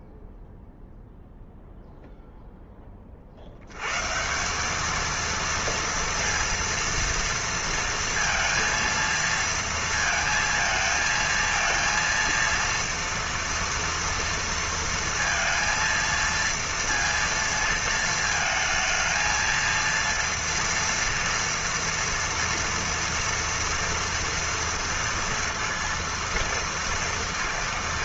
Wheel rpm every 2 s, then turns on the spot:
0, 10, 190, 230, 230, 230, 230, 230, 230, 220, 230, 230, 230, 230.
none